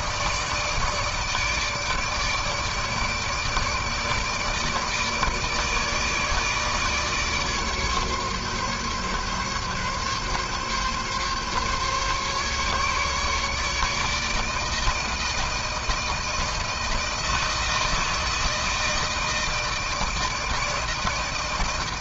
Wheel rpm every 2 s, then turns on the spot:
160, 150, 150, 150, 140, 140, 140, 160, 160, 160, 160.
none